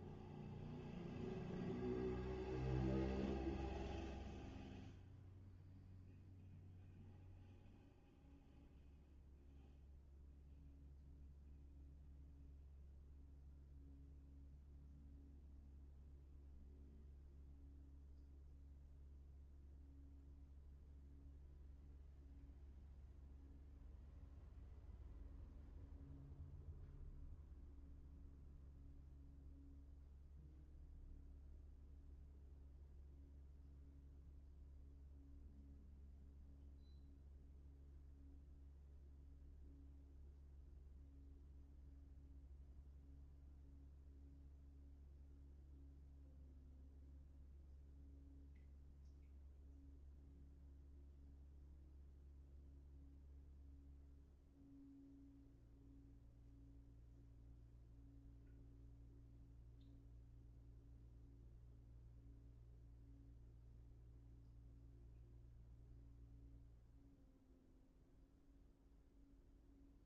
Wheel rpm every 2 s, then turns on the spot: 0, 0, 0, 0, 0, 0, 0, 0, 0, 0, 0, 0, 0, 0, 0, 0, 0, 0, 0, 0, 0, 0, 0, 0, 0, 0, 0, 0, 0, 0, 0, 0, 0, 0, 0.
none